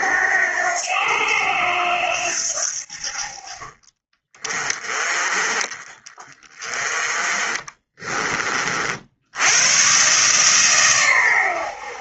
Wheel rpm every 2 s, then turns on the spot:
90, 70, 20, 20, 50, 120.
none